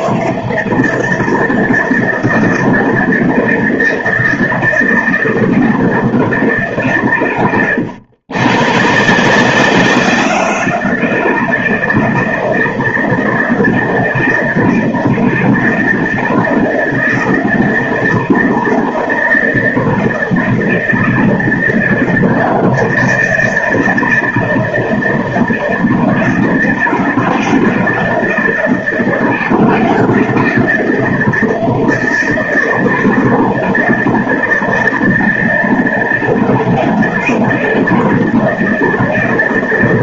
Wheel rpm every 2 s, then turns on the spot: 160, 160, 160, 140, 130, 170, 170, 160, 170, 160, 160, 170, 160, 160, 170, 170, 160, 160, 170, 160.
none